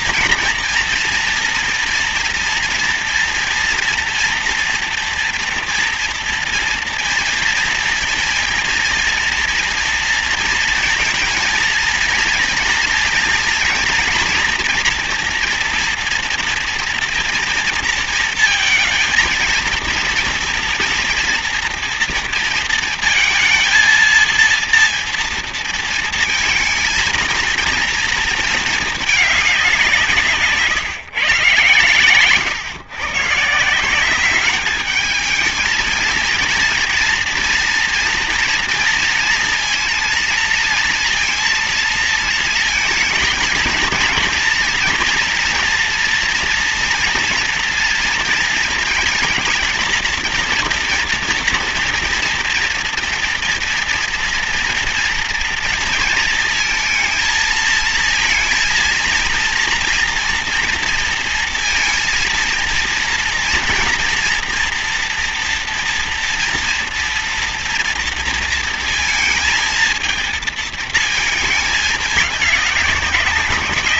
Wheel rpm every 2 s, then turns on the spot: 230, 230, 240, 230, 230, 230, 230, 240, 230, 220, 230, 230, 230, 220, 220, 150, 110, 210, 230, 230, 230, 220, 230, 230, 230, 230, 230, 240, 230, 220, 230, 230, 230, 230, 230, 220, 200.
none